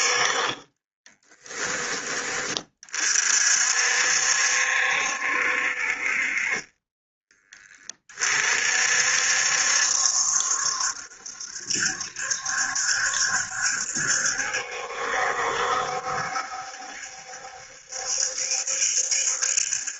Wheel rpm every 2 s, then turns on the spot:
30, 40, 70, 30, 60, 70, 70, 70, 70, 70.
0-2 6-8